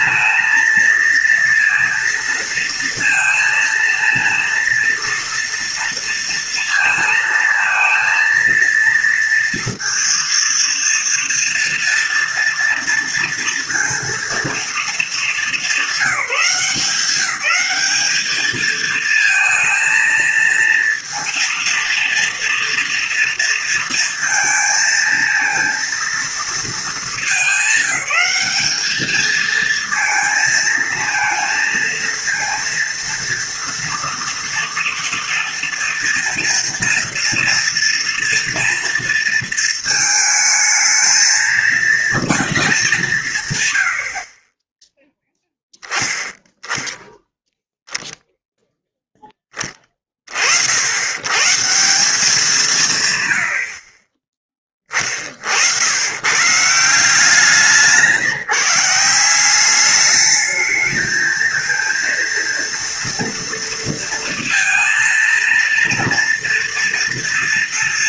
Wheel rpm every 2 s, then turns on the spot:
230, 230, 230, 230, 230, 230, 230, 230, 190, 210, 230, 230, 230, 230, 210, 220, 230, 230, 240, 230, 220, 220, 30, 0, 0, 60, 180, 10, 130, 160, 210, 230, 230, 230.
none